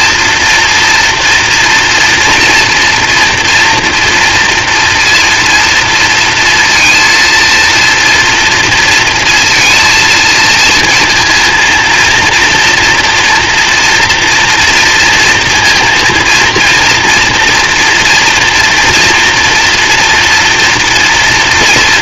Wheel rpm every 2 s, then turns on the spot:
230, 230, 230, 230, 230, 230, 240, 230, 230, 230, 230.
none